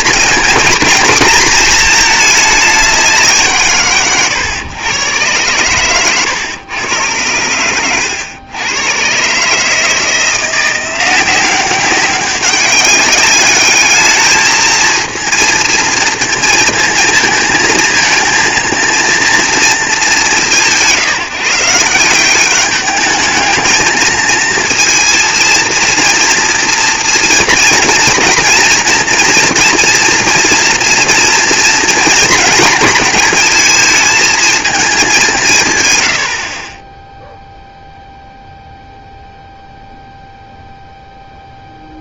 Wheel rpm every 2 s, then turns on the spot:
230, 200, 120, 100, 100, 170, 200, 220, 220, 220, 170, 200, 230, 230, 230, 230, 220, 220, 30, 0, 0.
36-38